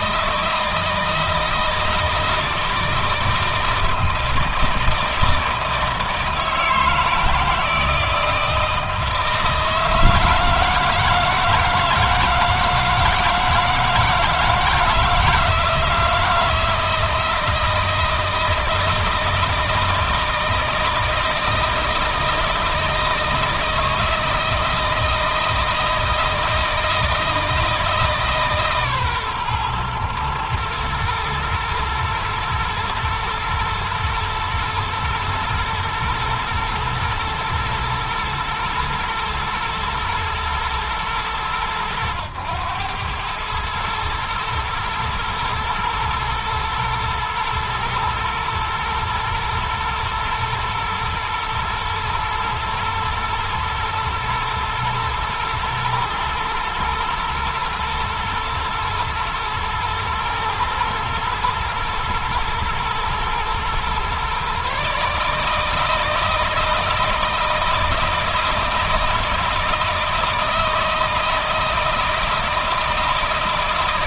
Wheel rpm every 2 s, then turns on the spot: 160, 160, 160, 160, 160, 150, 160, 160, 160, 160, 160, 160, 160, 160, 140, 110, 110, 120, 120, 120, 100, 100, 110, 110, 110, 110, 110, 110, 110, 110, 110, 110, 140, 160, 160, 160, 160.
none